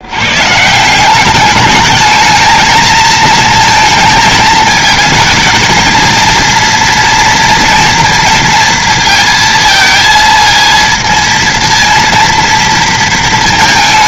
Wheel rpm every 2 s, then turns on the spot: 190, 220, 220, 230, 230, 230, 230.
none